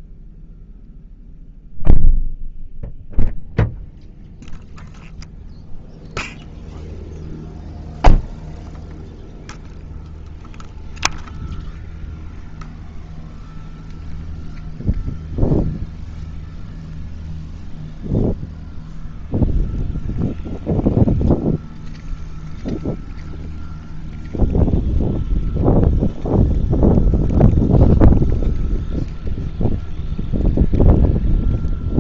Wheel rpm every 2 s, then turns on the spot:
0, 0, 0, 0, 0, 0, 0, 0, 0, 0, 0, 0, 0, 0, 0, 0.
none